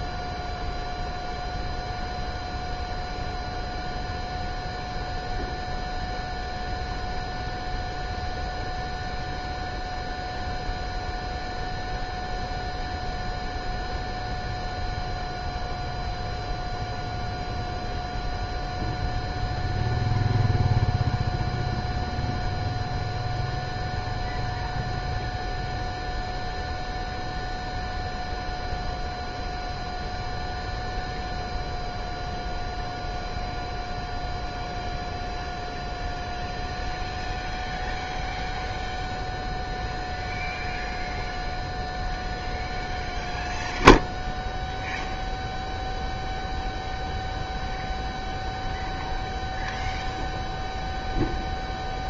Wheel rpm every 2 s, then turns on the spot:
0, 0, 0, 0, 0, 0, 0, 0, 0, 0, 0, 0, 0, 0, 0, 0, 0, 0, 0, 0, 0, 0, 0, 0, 0, 0.
none